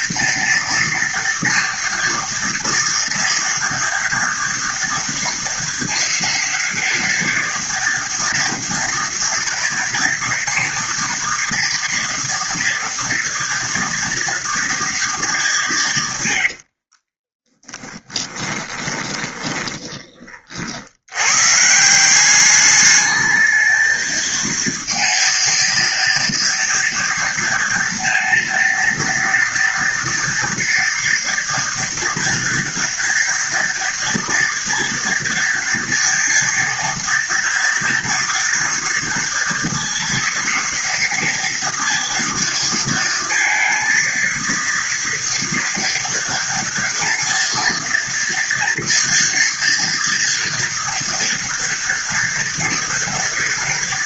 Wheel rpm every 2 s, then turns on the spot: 230, 230, 230, 230, 230, 230, 230, 220, 30, 20, 80, 210, 230, 230, 230, 240, 230, 230, 230, 230, 230, 230, 230, 230, 230, 230, 230.
16-20